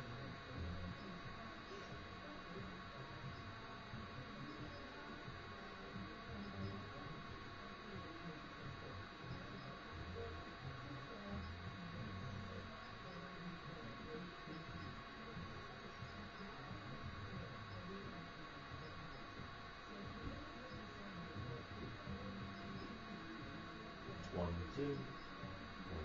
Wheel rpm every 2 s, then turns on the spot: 0, 0, 0, 0, 0, 0, 0, 0, 0, 0, 0, 0, 0.
none